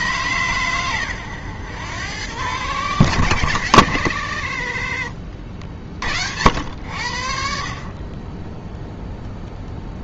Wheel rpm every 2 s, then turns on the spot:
120, 120, 50, 80, 0.
none